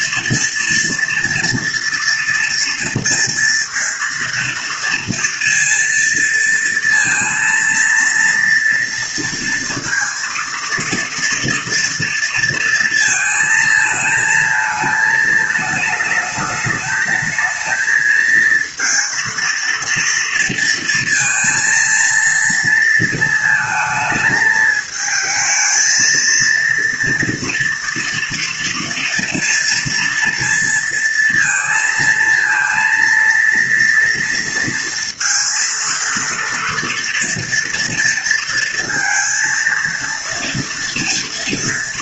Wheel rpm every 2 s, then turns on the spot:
230, 230, 230, 230, 230, 230, 230, 220, 220, 230, 230, 230, 220, 230, 230, 230, 230, 230, 230, 230, 230.
none